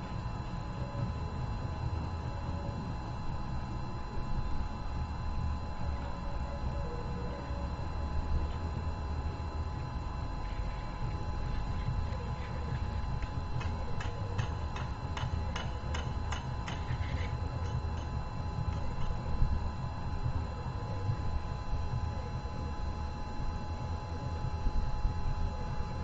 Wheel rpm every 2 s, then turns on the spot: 0, 0, 0, 0, 0, 0, 0, 0, 0, 0, 0, 0, 0.
none